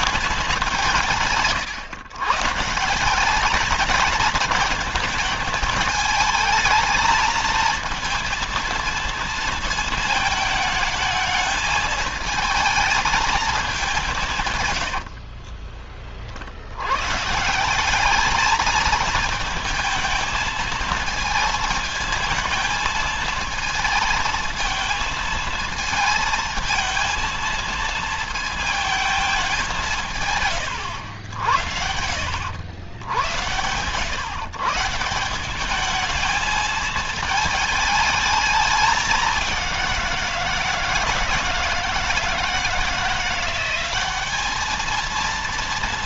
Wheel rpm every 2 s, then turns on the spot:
170, 170, 220, 220, 230, 220, 220, 110, 110, 220, 220, 220, 230, 220, 220, 100, 110, 150, 220, 200, 160, 170, 220.
14-16